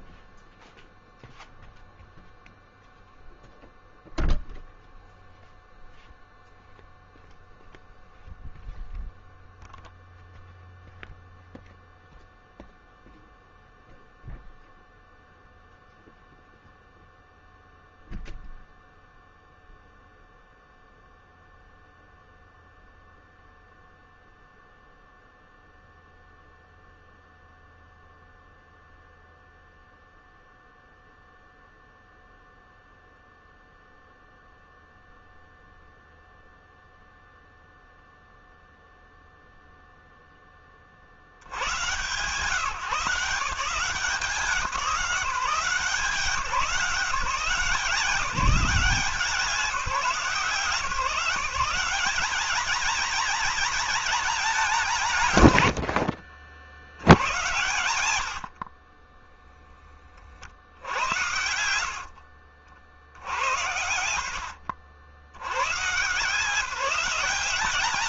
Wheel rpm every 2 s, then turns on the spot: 0, 0, 0, 0, 0, 0, 0, 0, 0, 0, 0, 0, 0, 0, 0, 0, 0, 0, 0, 0, 40, 160, 180, 180, 180, 160, 220, 190, 80, 40, 80, 80, 90, 190.
none